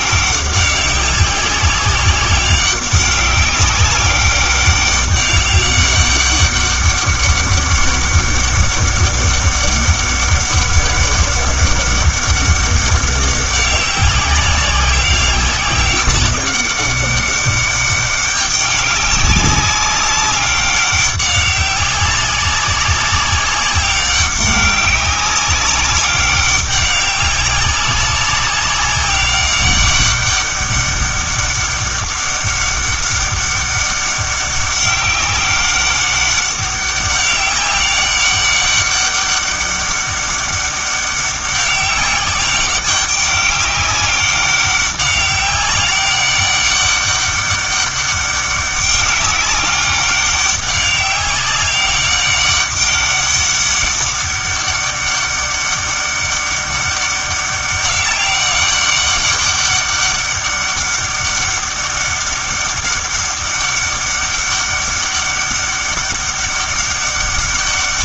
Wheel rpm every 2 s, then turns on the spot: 190, 200, 200, 200, 200, 200, 200, 190, 200, 200, 200, 190, 200, 200, 200, 200, 200, 200, 190, 200, 200, 200, 200, 200, 200, 200, 200, 200, 200, 200, 200, 200, 200, 200.
none